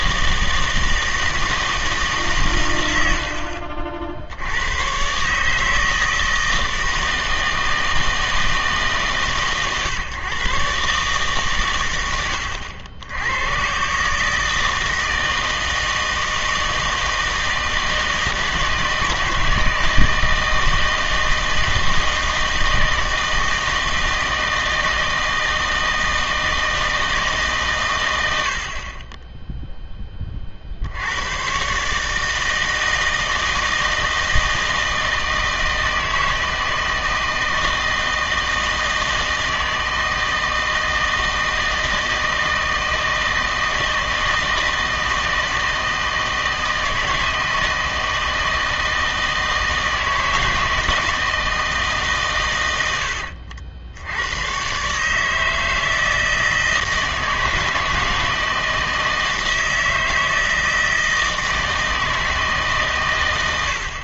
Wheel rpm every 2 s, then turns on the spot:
160, 110, 110, 160, 150, 140, 90, 160, 160, 160, 160, 160, 160, 160, 50, 70, 160, 160, 160, 160, 160, 160, 160, 160, 160, 160, 100, 130, 160, 160, 160, 140.
none